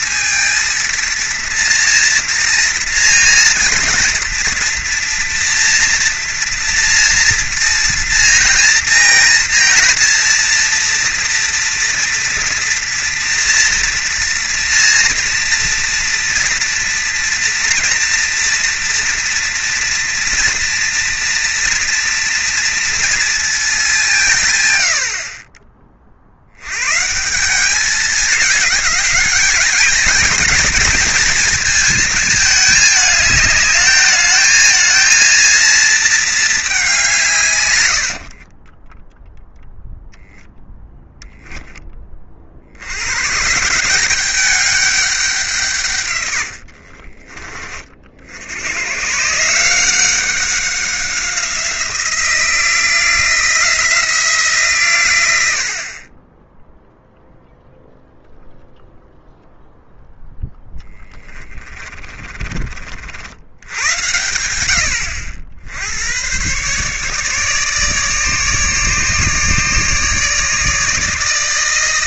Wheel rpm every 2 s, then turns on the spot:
230, 230, 230, 230, 230, 230, 230, 230, 230, 230, 230, 230, 100, 130, 210, 230, 220, 220, 200, 10, 0, 70, 200, 60, 110, 190, 170, 140, 0, 0, 10, 40, 90, 140, 150, 150.
38-40 46-48 60-62